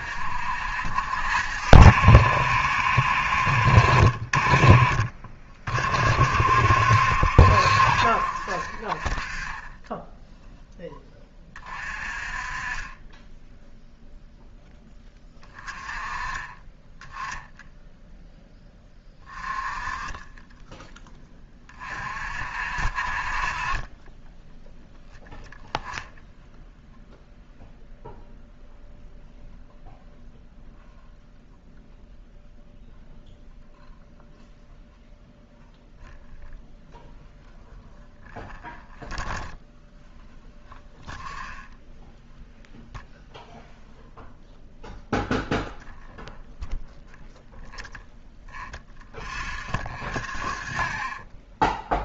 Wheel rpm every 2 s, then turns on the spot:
60, 60, 30, 60, 30, 10, 20, 10, 20, 10, 10, 40, 10, 0, 0, 0, 0, 0, 0, 0, 0, 0, 0, 0, 0, 30.
none